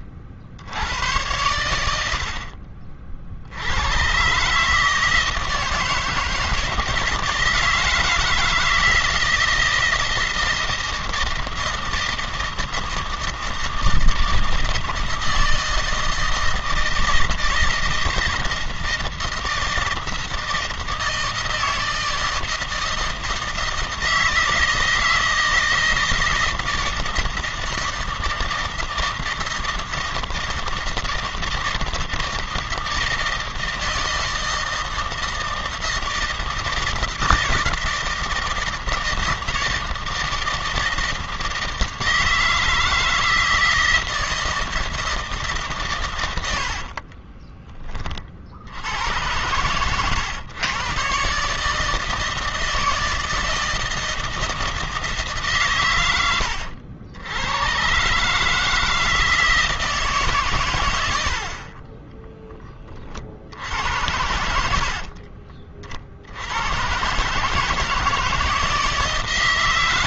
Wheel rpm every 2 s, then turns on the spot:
80, 50, 140, 160, 160, 160, 160, 160, 160, 160, 160, 160, 160, 160, 160, 160, 160, 160, 160, 160, 160, 160, 160, 80, 60, 110, 160, 160, 90, 160, 120, 30, 80, 90, 160.
46-48